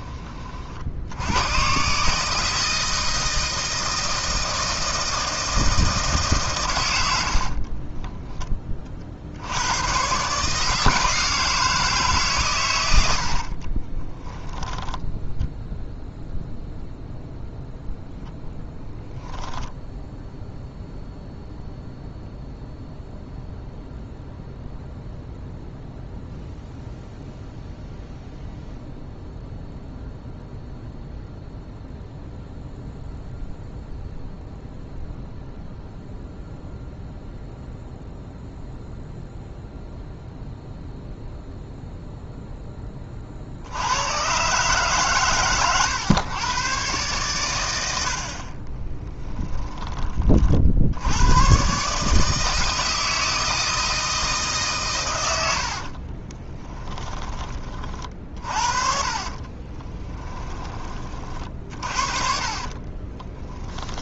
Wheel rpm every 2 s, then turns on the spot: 60, 160, 160, 100, 40, 160, 100, 10, 0, 0, 0, 0, 0, 0, 0, 0, 0, 0, 0, 0, 0, 20, 140, 120, 20, 70, 160, 140, 10, 40, 30, 40.
14-16 48-50 56-60 62-64